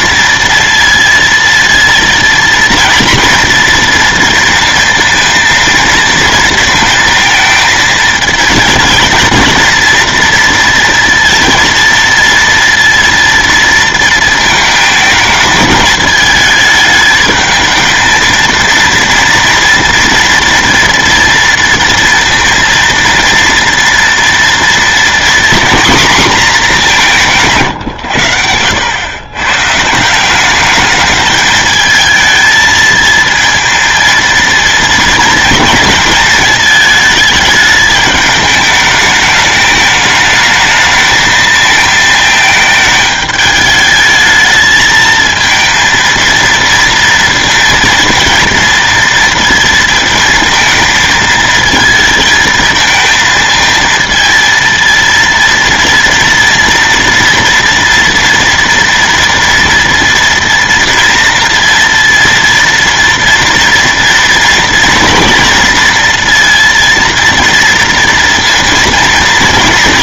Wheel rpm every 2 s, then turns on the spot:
230, 230, 230, 230, 230, 230, 230, 220, 220, 230, 230, 230, 230, 220, 100, 200, 220, 230, 220, 210, 220, 220, 220, 230, 230, 230, 220, 230, 230, 240, 230, 230, 230, 230, 230.
28-30